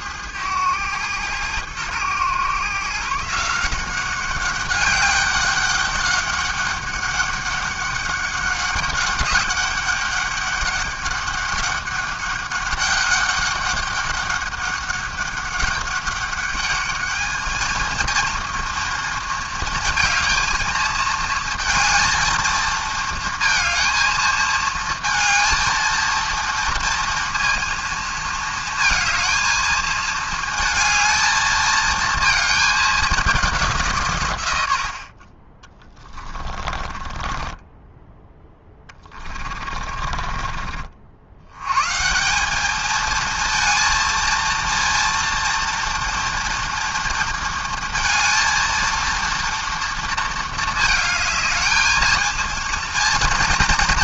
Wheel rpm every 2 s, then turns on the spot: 110, 120, 200, 200, 200, 200, 200, 200, 210, 230, 220, 230, 230, 230, 220, 220, 220, 90, 20, 10, 40, 200, 230, 230, 230, 230, 230.
36-40